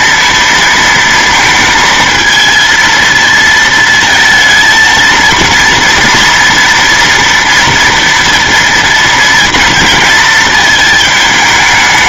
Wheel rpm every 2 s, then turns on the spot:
230, 220, 230, 240, 230, 220.
none